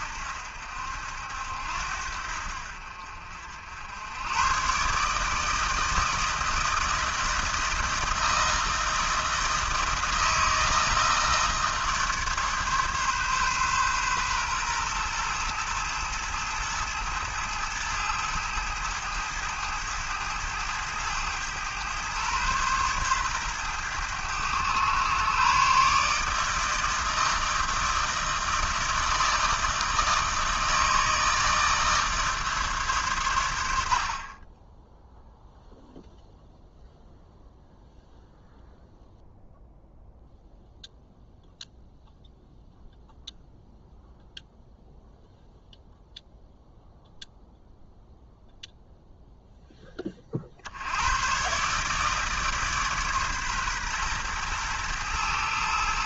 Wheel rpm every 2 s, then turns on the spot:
70, 60, 130, 160, 160, 160, 140, 120, 110, 110, 110, 120, 110, 160, 160, 160, 140, 20, 0, 0, 0, 0, 0, 0, 0, 70, 150, 110.
none